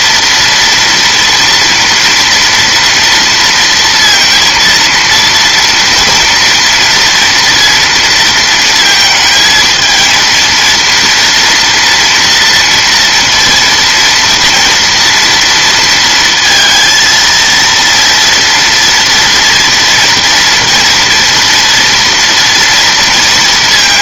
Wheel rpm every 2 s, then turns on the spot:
240, 230, 230, 230, 220, 230, 230, 230, 230, 230, 230, 230.
none